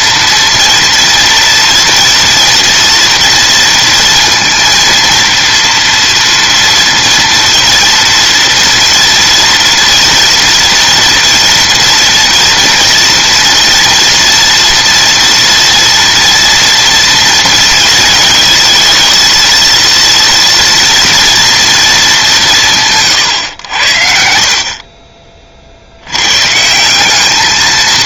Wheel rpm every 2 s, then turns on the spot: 230, 230, 230, 230, 230, 230, 230, 230, 230, 220, 230, 160, 40, 180.
none